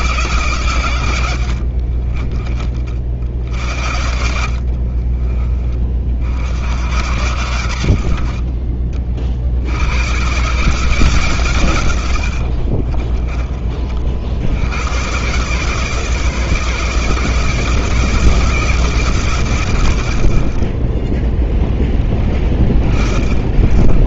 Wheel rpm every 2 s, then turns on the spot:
140, 30, 50, 50, 60, 130, 80, 70, 150, 160, 80, 20.
2-6 12-14